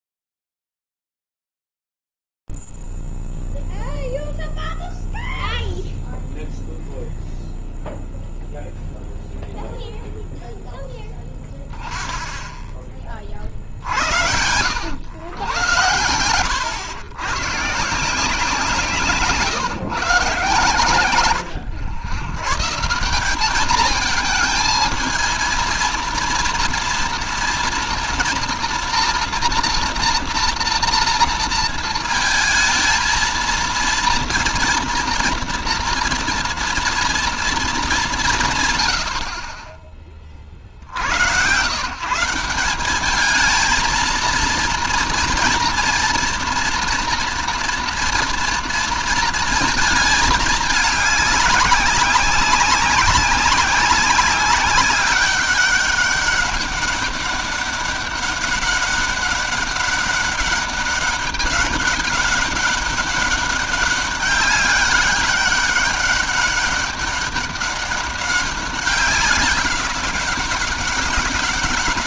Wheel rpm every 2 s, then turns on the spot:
0, 0, 0, 0, 0, 0, 0, 90, 100, 160, 140, 130, 220, 230, 230, 230, 220, 230, 230, 160, 40, 170, 230, 240, 230, 210, 190, 190, 200, 200, 200, 200, 200, 200, 200, 200.
none